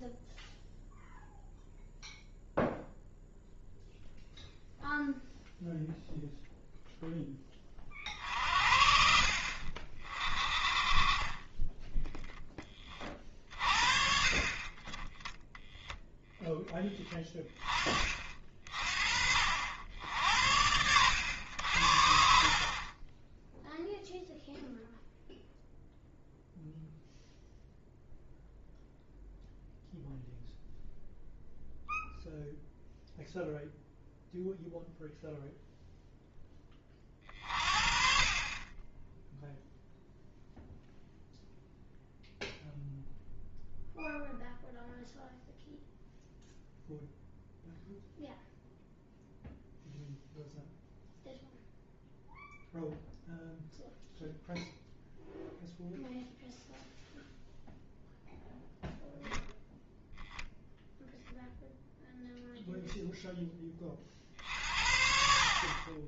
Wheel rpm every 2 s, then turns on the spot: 0, 0, 0, 0, 60, 30, 20, 30, 10, 40, 90, 30, 0, 0, 0, 0, 0, 0, 30, 20, 0, 0, 0, 0, 0, 0, 0, 0, 0, 0, 0, 0, 50.
16-18